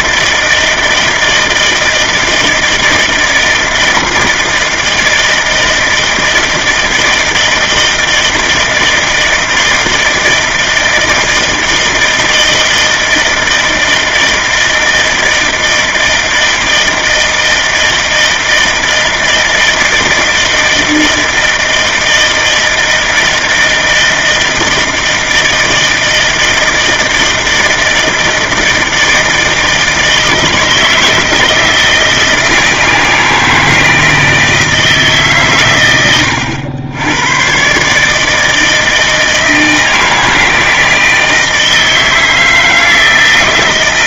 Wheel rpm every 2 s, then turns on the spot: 160, 160, 160, 160, 160, 160, 160, 160, 160, 160, 160, 160, 160, 160, 160, 160, 160, 150, 100, 160, 160, 160.
none